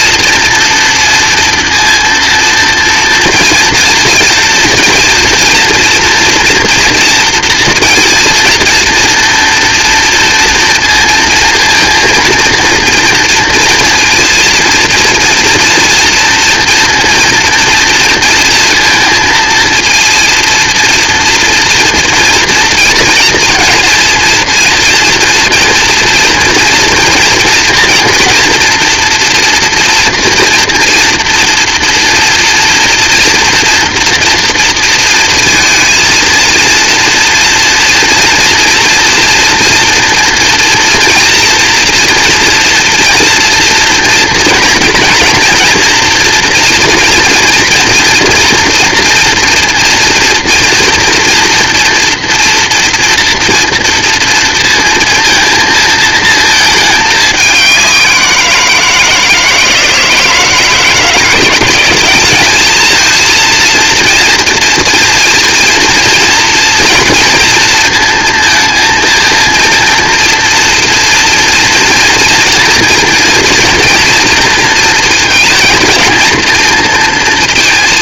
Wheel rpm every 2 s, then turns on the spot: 230, 230, 240, 230, 230, 230, 230, 230, 230, 230, 230, 230, 230, 230, 230, 230, 230, 230, 240, 230, 230, 230, 230, 230, 230, 230, 230, 230, 210, 160, 170, 220, 230, 230, 230, 230, 230, 230, 230.
none